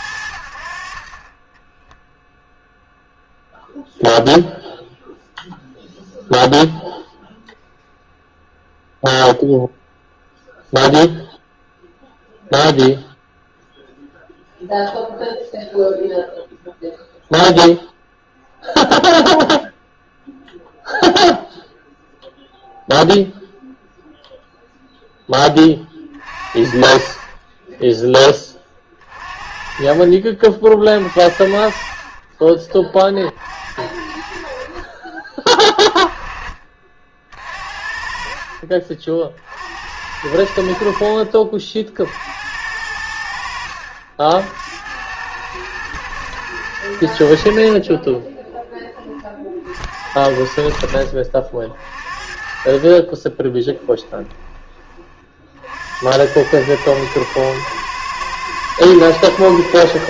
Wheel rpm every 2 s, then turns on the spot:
60, 0, 0, 0, 0, 0, 0, 0, 0, 0, 0, 0, 0, 40, 20, 40, 40, 50, 30, 50, 60, 70, 80, 110, 20, 60, 40, 20, 100, 110.
32-34 38-40 48-50 52-54